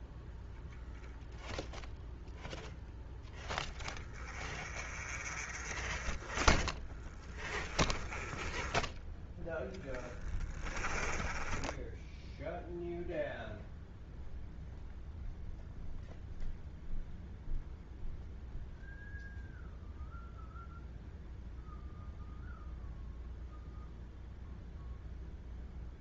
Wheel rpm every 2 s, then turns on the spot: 0, 20, 40, 20, 10, 10, 0, 0, 0, 0, 0, 0, 0.
6-8